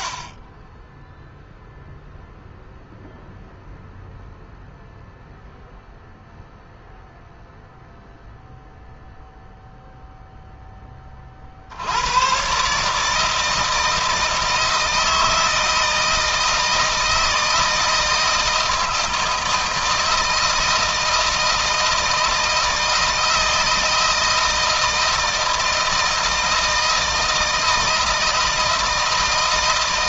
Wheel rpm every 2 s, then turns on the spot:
10, 0, 0, 0, 0, 20, 150, 160, 160, 160, 160, 160, 160, 160, 160.
none